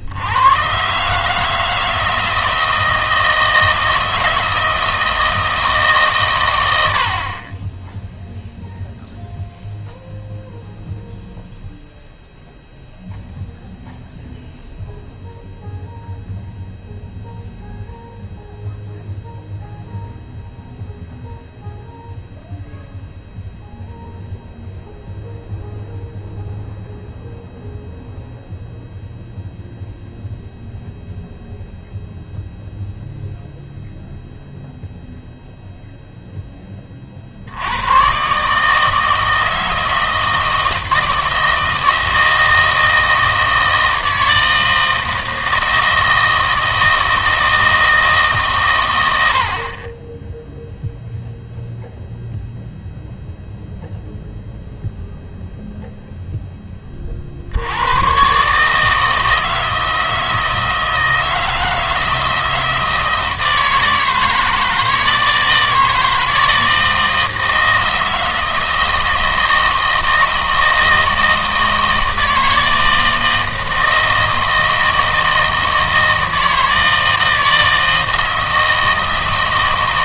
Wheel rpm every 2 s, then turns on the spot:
120, 160, 160, 100, 0, 0, 0, 0, 0, 0, 0, 0, 0, 0, 0, 0, 0, 0, 20, 150, 160, 160, 160, 160, 120, 0, 0, 0, 10, 150, 160, 160, 160, 160, 160, 160, 160, 160, 160, 160.
none